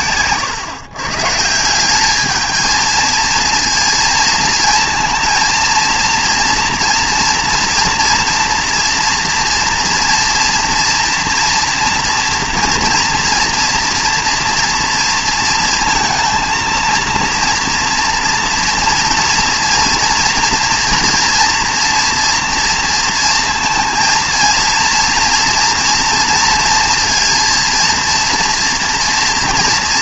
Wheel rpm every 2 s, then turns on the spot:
120, 220, 230, 230, 240, 230, 230, 230, 230, 230, 230, 230, 230, 230, 230.
none